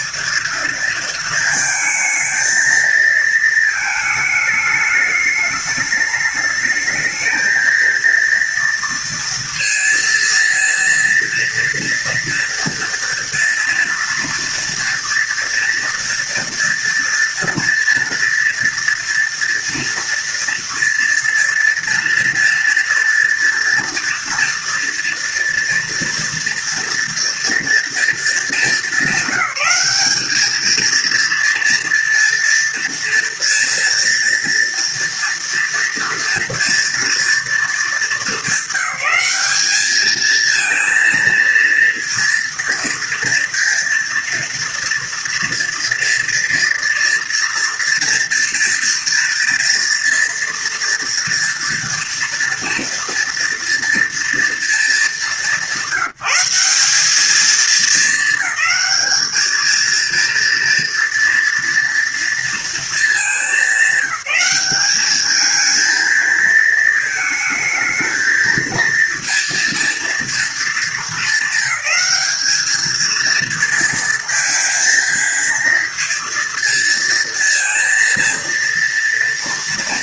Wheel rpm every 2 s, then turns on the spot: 230, 220, 210, 220, 230, 230, 230, 230, 230, 230, 230, 230, 230, 230, 200, 230, 230, 230, 230, 210, 230, 230, 230, 230, 230, 230, 240, 210, 200, 220, 230, 220, 210, 220, 230, 220, 220, 230, 230, 240.
none